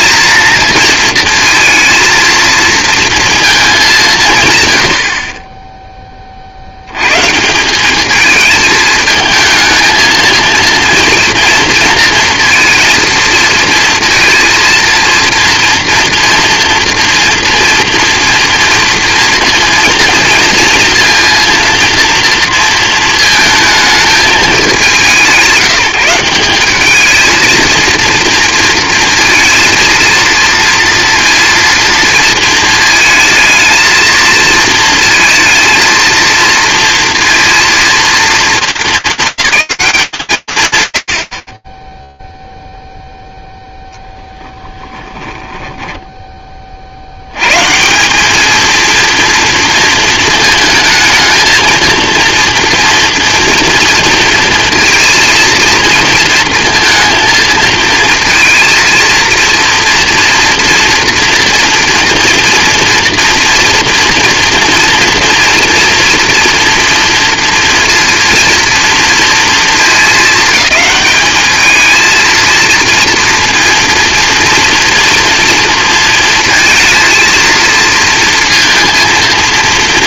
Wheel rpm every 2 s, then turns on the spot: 230, 230, 110, 80, 220, 230, 230, 230, 230, 240, 230, 230, 200, 200, 230, 230, 220, 230, 230, 210, 130, 0, 20, 50, 230, 220, 230, 230, 220, 230, 230, 240, 230, 230, 230, 210, 230, 230, 230, 230.
44-46